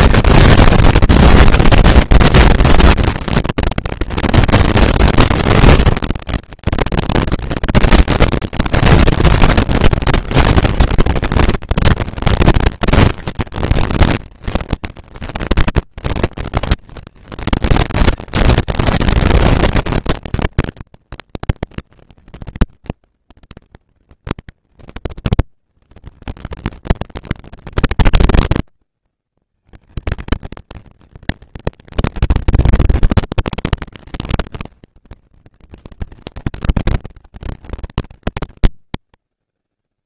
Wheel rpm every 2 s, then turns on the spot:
230, 230, 230, 200, 200, 210, 210, 230, 240, 230, 230, 230, 230, 230, 230, 230, 230, 230, 220, 210.
none